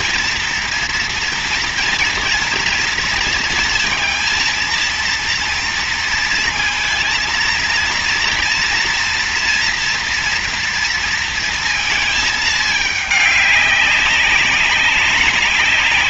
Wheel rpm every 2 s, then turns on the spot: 230, 230, 230, 230, 230, 230, 210, 200.
none